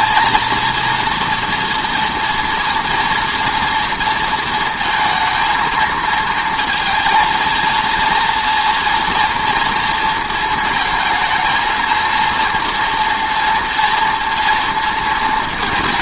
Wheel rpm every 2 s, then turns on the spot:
240, 240, 230, 230, 230, 220, 230, 240.
none